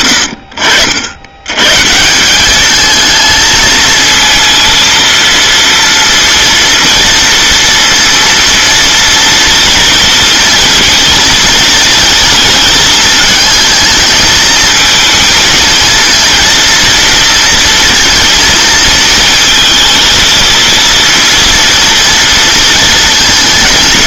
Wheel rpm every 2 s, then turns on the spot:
80, 220, 230, 230, 230, 230, 230, 220, 230, 220, 230, 230.
none